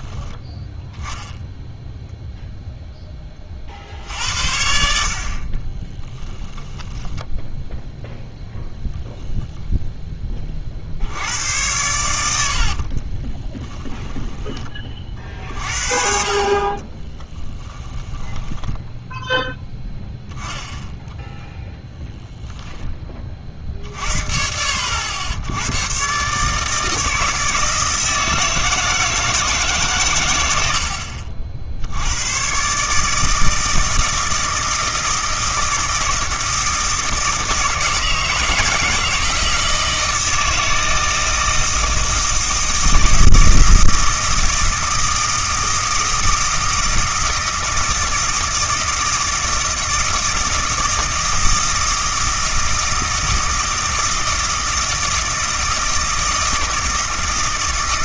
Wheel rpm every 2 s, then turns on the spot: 10, 0, 60, 10, 0, 50, 50, 30, 30, 10, 0, 10, 70, 150, 160, 80, 140, 160, 160, 160, 160, 160, 160, 160, 160, 160, 160, 160, 160.
6-8 12-14 16-20